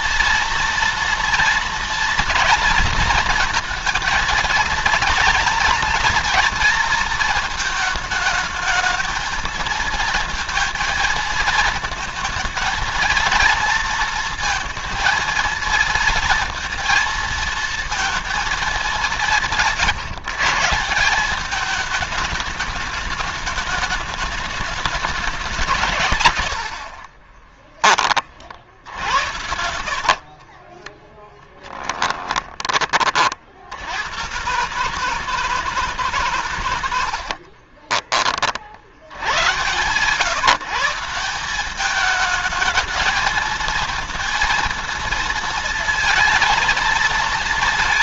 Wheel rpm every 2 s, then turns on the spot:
230, 230, 230, 230, 220, 230, 220, 230, 230, 220, 160, 210, 210, 80, 50, 30, 20, 130, 120, 50, 160, 220, 230, 230.
26-28 30-32